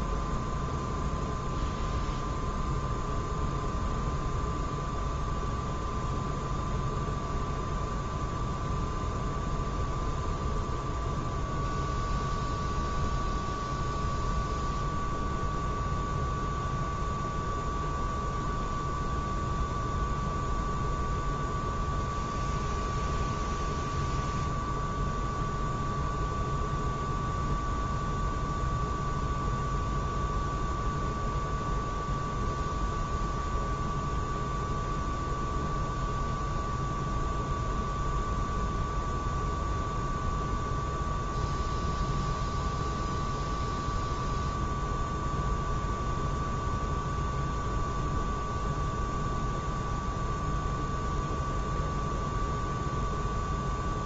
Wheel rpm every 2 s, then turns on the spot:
0, 0, 0, 0, 0, 0, 0, 0, 0, 0, 0, 0, 0, 0, 0, 0, 0, 0, 0, 0, 0, 0, 0, 0, 0, 0, 0.
none